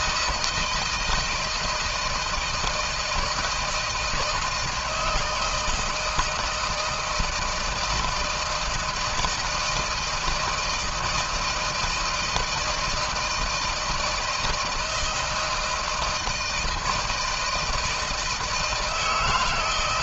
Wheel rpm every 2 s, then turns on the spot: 160, 160, 170, 160, 160, 160, 160, 160, 160, 160.
none